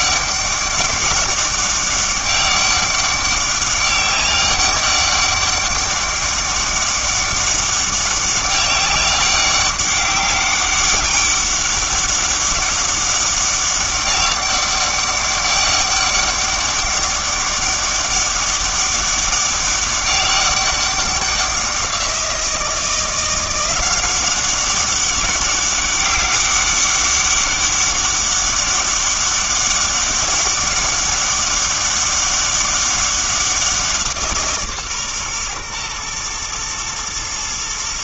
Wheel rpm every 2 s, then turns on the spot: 200, 200, 200, 200, 200, 200, 200, 200, 200, 200, 200, 170, 190, 200, 200, 200, 200, 140, 120.
none